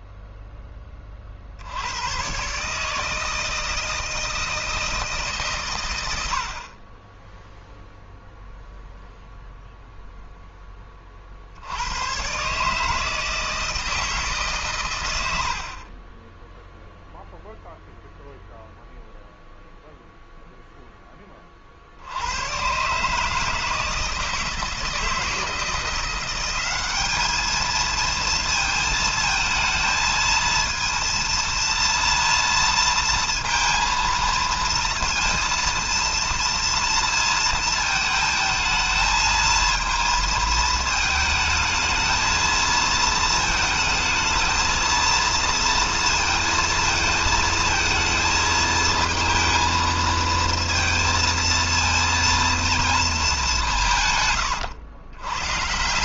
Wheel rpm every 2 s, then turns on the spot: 30, 150, 160, 30, 0, 30, 150, 120, 0, 0, 10, 140, 160, 200, 230, 230, 230, 230, 230, 220, 220, 220, 230, 230, 220, 230, 220, 110.
none